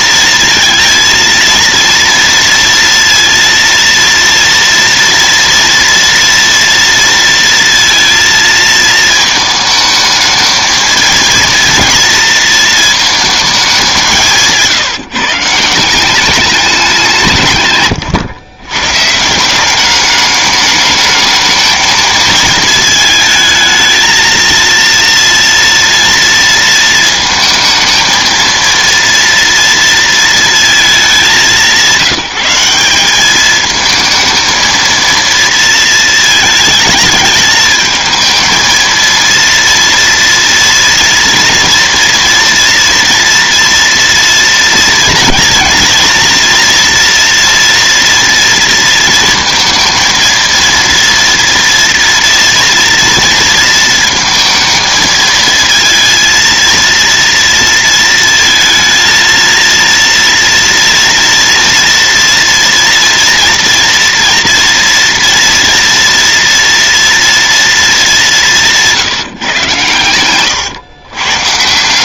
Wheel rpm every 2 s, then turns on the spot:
230, 230, 230, 230, 220, 230, 230, 150, 190, 140, 210, 230, 230, 230, 230, 220, 190, 220, 220, 220, 230, 230, 230, 230, 230, 230, 230, 220, 230, 230, 230, 230, 230, 230, 180, 120.
none